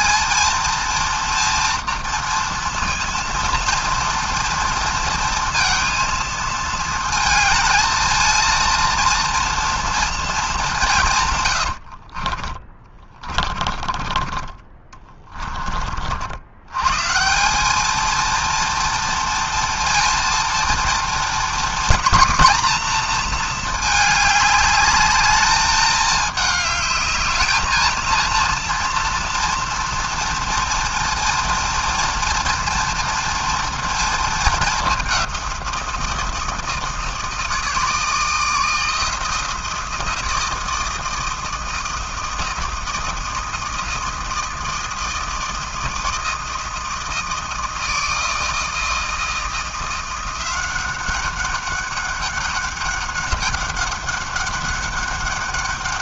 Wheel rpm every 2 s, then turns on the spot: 230, 230, 230, 230, 230, 180, 20, 30, 100, 230, 230, 230, 210, 210, 230, 230, 230, 210, 160, 160, 160, 160, 160, 160, 160, 190, 200, 200.
12-16